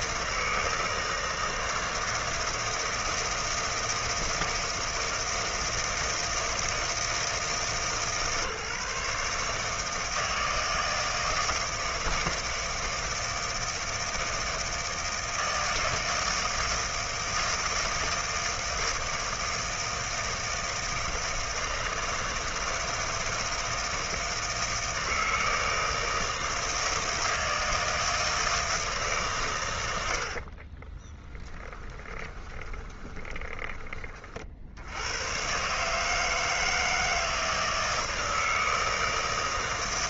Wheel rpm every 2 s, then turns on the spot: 160, 160, 160, 160, 150, 160, 160, 160, 160, 160, 160, 160, 160, 160, 160, 30, 20, 80, 160, 160.
30-34